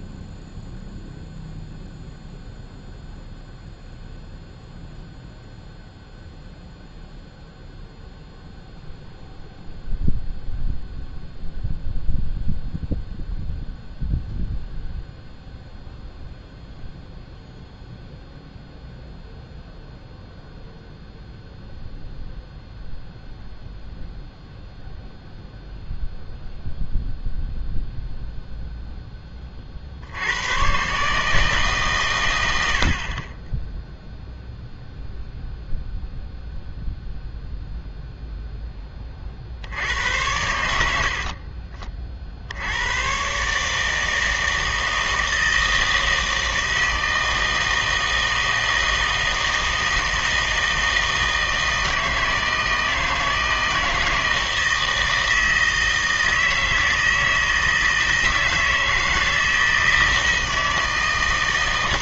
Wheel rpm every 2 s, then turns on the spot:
0, 0, 0, 0, 0, 0, 0, 0, 0, 0, 0, 0, 0, 0, 0, 110, 80, 0, 0, 10, 90, 80, 160, 160, 160, 160, 160, 160, 160, 160, 160.
none